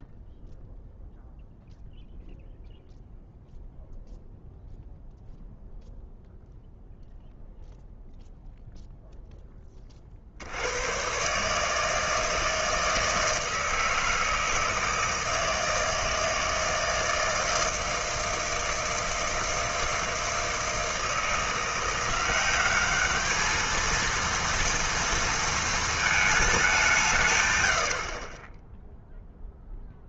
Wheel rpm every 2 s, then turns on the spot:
0, 0, 0, 0, 0, 90, 160, 160, 160, 160, 160, 190, 230, 200, 10.
none